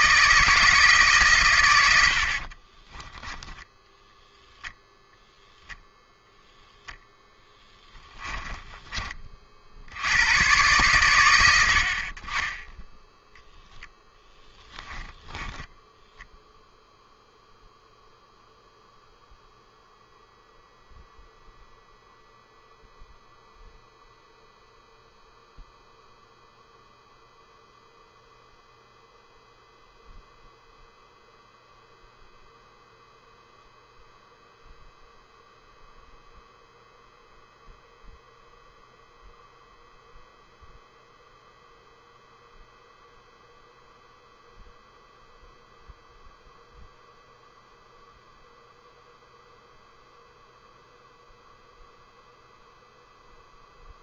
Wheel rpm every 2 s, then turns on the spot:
150, 30, 10, 0, 20, 120, 10, 10, 0, 0, 0, 0, 0, 0, 0, 0, 0, 0, 0, 0, 0, 0, 0, 0, 0, 0, 0.
2-6